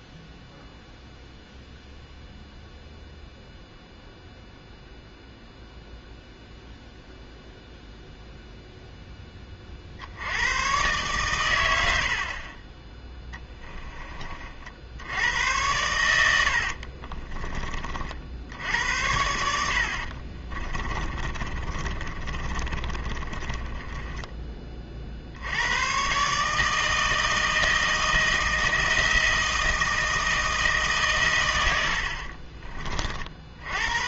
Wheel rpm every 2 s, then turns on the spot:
0, 0, 0, 0, 0, 120, 20, 70, 60, 80, 30, 30, 40, 160, 160, 150, 30.
16-18 20-24